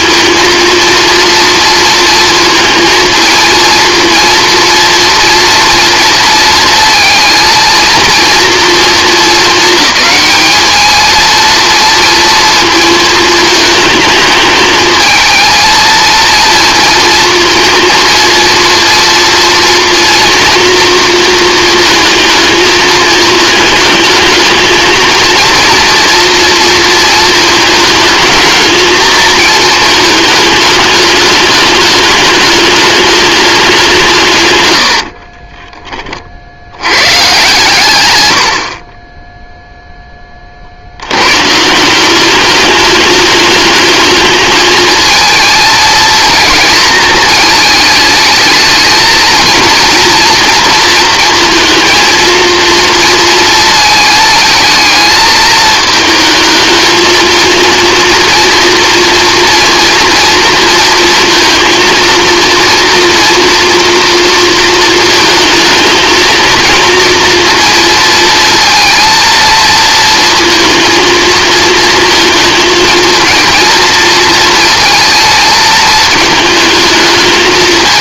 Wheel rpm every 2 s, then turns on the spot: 230, 230, 230, 220, 230, 220, 230, 220, 230, 230, 230, 220, 220, 230, 220, 220, 210, 100, 70, 60, 60, 210, 220, 220, 220, 230, 230, 220, 220, 230, 230, 230, 230, 230, 230, 230, 230, 230, 220.
34-36